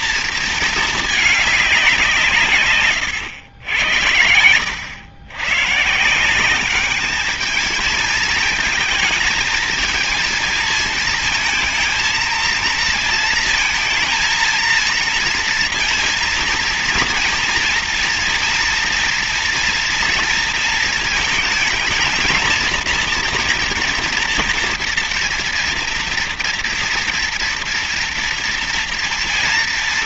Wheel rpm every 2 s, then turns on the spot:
230, 160, 80, 180, 220, 230, 230, 230, 230, 230, 230, 220, 230, 230, 230.
none